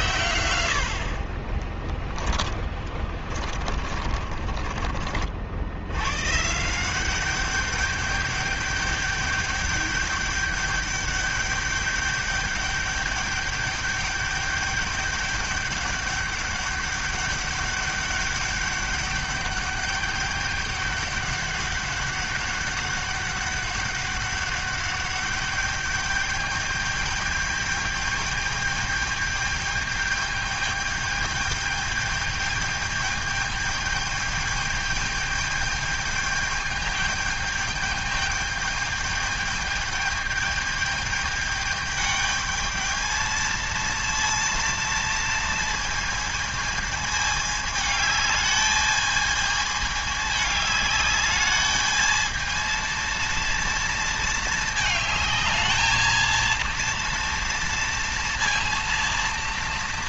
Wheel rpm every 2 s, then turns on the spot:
120, 30, 30, 150, 200, 200, 210, 210, 200, 200, 200, 200, 200, 210, 210, 210, 210, 210, 210, 210, 210, 220, 230, 220, 210, 210, 230, 220, 230, 230.
0-6